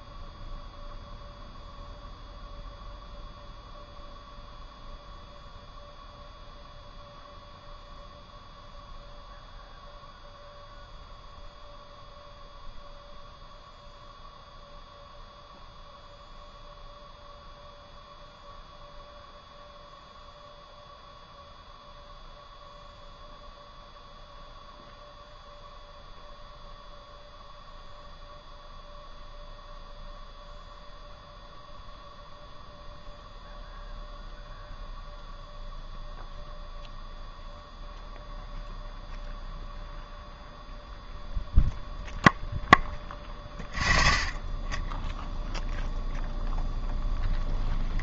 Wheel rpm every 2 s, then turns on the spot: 0, 0, 0, 0, 0, 0, 0, 0, 0, 0, 0, 0, 0, 0, 0, 0, 0, 0, 0, 0, 0, 0, 0, 0.
none